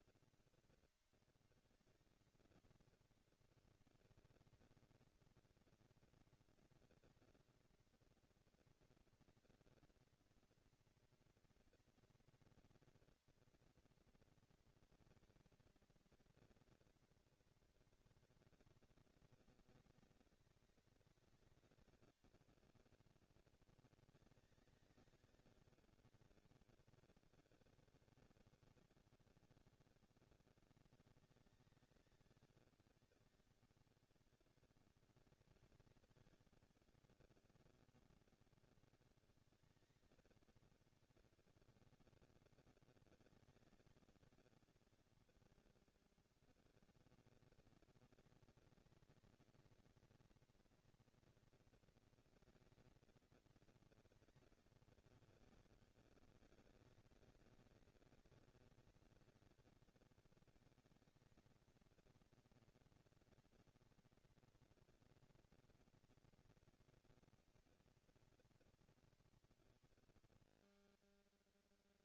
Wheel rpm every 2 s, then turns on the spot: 220, 230, 230, 230, 240, 230, 230, 230, 230, 200, 200, 200, 190, 200, 190, 200, 200, 200, 200, 200, 200, 200, 200, 200, 230, 230, 230, 200, 190, 200, 210, 230, 230, 230, 150, 90.
none